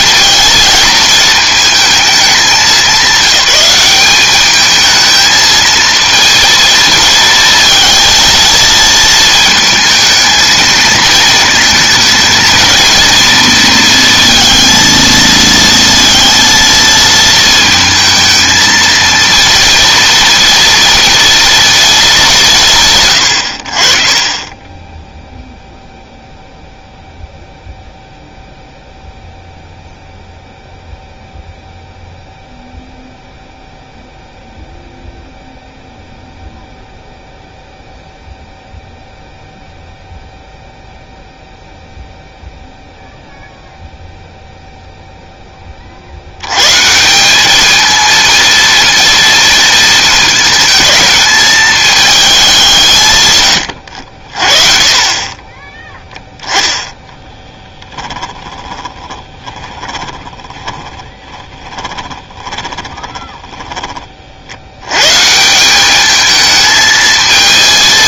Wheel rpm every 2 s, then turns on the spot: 220, 200, 210, 230, 220, 230, 230, 230, 230, 220, 240, 150, 10, 0, 0, 0, 0, 0, 0, 0, 0, 0, 0, 140, 230, 220, 160, 40, 10, 20, 20, 20, 90, 220.
24-26 58-64